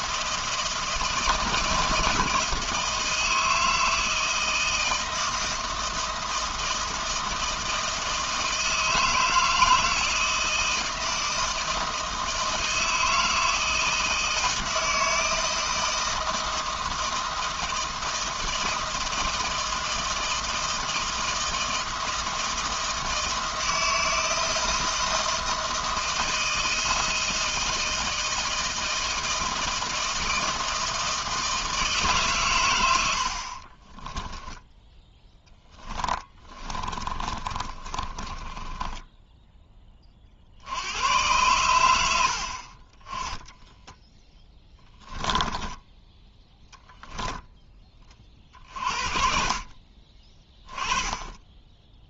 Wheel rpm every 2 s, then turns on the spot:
160, 160, 160, 160, 160, 160, 160, 160, 160, 160, 160, 160, 160, 160, 160, 160, 90, 10, 30, 10, 90, 30, 10, 0, 50, 20.
34-40 44-46